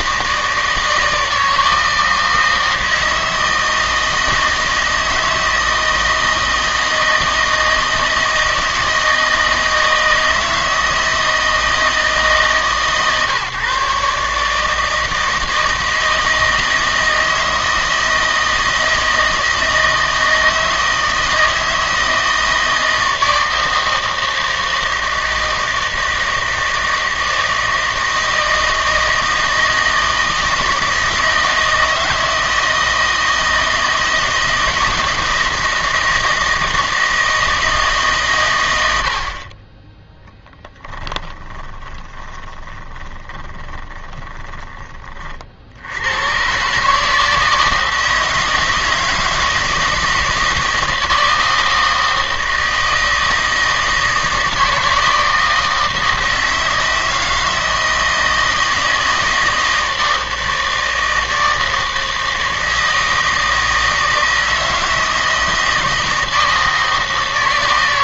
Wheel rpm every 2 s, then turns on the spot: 160, 160, 160, 160, 160, 160, 150, 150, 160, 160, 160, 160, 160, 160, 160, 160, 160, 160, 160, 100, 10, 20, 20, 140, 160, 170, 160, 160, 160, 160, 160, 160, 160, 160.
40-44